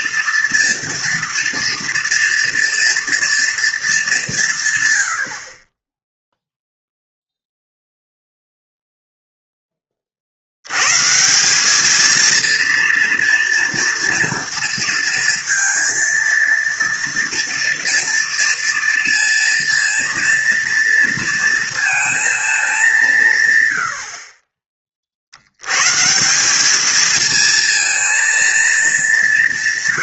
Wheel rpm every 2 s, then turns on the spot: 230, 230, 150, 0, 0, 100, 230, 230, 230, 230, 230, 210, 30, 200, 220.
none